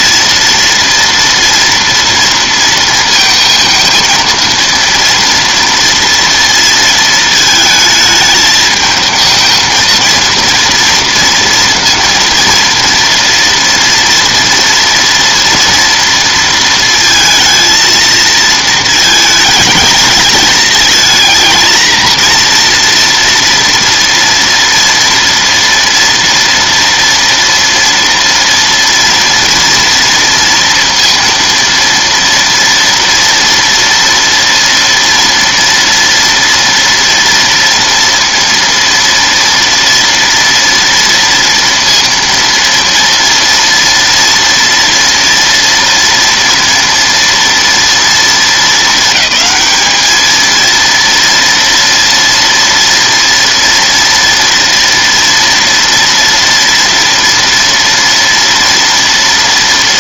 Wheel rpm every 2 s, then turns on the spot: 230, 230, 230, 230, 220, 230, 230, 230, 230, 220, 220, 230, 230, 230, 230, 230, 230, 230, 230, 230, 230, 230, 230, 230, 220, 230, 230, 230, 230, 230.
none